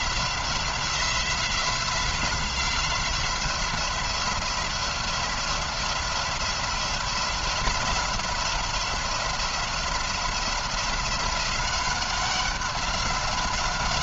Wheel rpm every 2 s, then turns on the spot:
180, 180, 180, 180, 170, 180, 190.
none